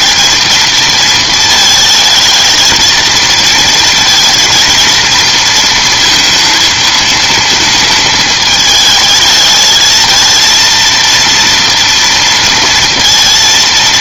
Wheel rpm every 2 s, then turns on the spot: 230, 220, 230, 230, 220, 230, 230.
none